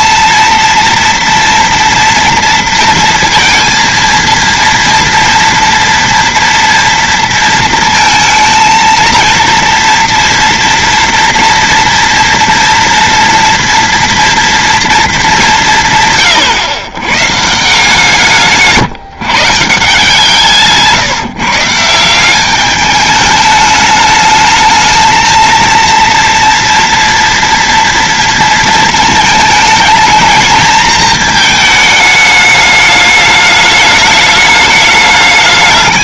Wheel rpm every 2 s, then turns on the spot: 230, 230, 230, 230, 220, 230, 230, 230, 150, 160, 160, 170, 210, 230, 230, 220, 220, 210.
none